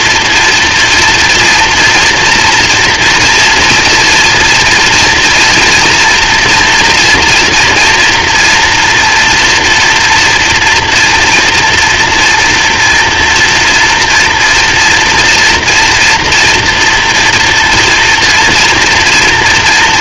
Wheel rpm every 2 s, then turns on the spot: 230, 230, 230, 240, 230, 230, 230, 230, 240, 230.
none